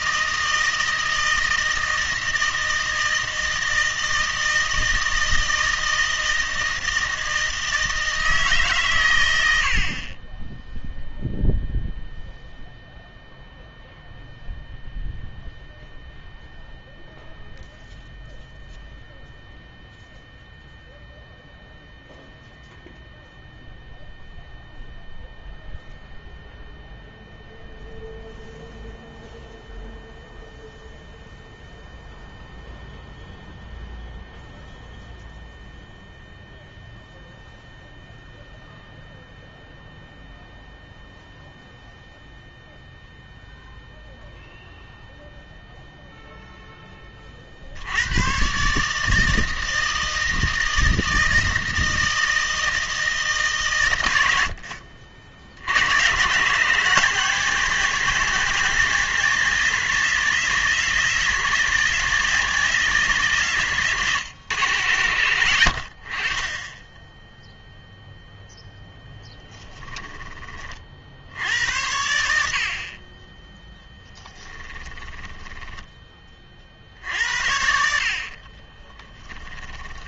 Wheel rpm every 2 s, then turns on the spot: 160, 160, 160, 160, 140, 0, 0, 0, 0, 0, 0, 0, 0, 0, 0, 0, 0, 0, 0, 0, 0, 0, 0, 10, 140, 160, 160, 60, 160, 180, 190, 190, 120, 20, 0, 30, 60, 20, 50, 30.
74-76 78-80